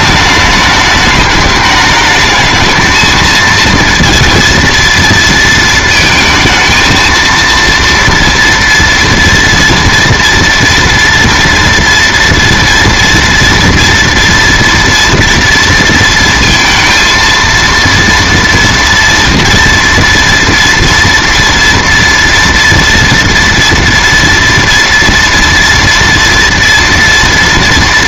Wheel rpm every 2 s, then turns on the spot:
210, 220, 230, 220, 230, 230, 230, 230, 230, 230, 230, 230, 230, 230.
none